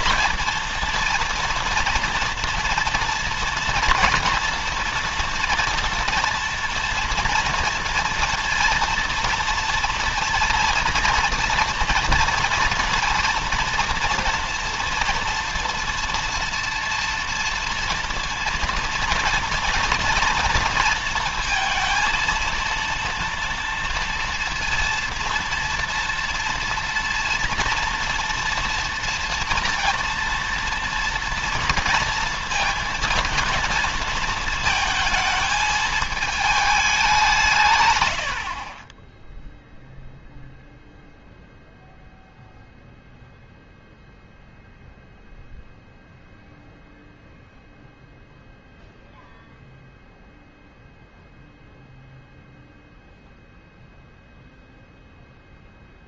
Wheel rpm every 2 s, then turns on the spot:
220, 230, 230, 230, 230, 230, 230, 230, 230, 230, 230, 230, 230, 230, 230, 230, 230, 230, 200, 30, 0, 0, 0, 0, 0, 0, 0, 10.
none